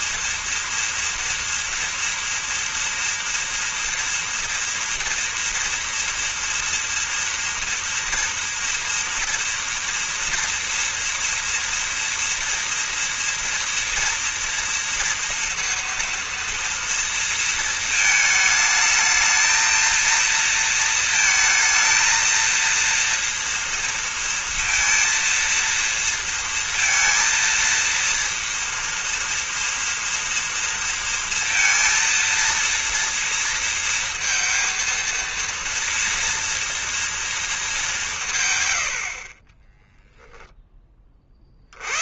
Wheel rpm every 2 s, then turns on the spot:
230, 230, 230, 230, 230, 230, 230, 230, 230, 220, 230, 230, 230, 230, 230, 230, 230, 230, 230, 80, 20.
none